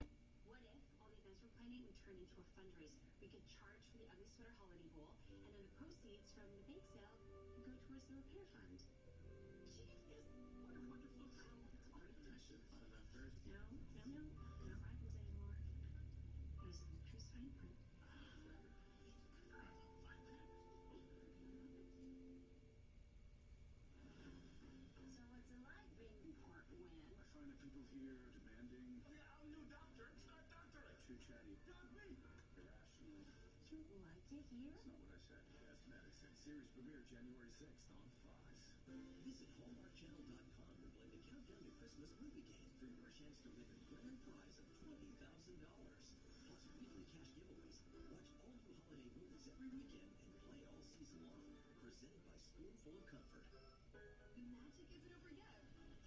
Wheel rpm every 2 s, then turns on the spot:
0, 0, 0, 0, 0, 0, 0, 0, 0, 0, 0, 0, 0, 0, 0, 0, 0, 0, 0, 0, 0, 0, 0, 0, 0, 0, 0, 0.
none